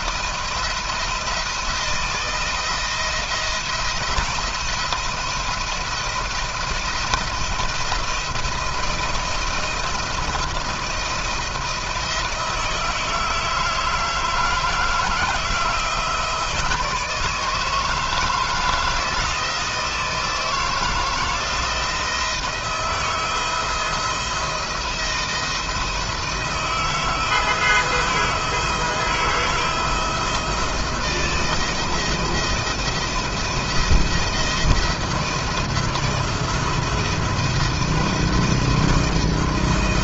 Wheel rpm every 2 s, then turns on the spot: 170, 170, 170, 170, 160, 170, 160, 160, 160, 160, 170, 160, 160, 170, 170, 170, 170, 170, 170, 170.
none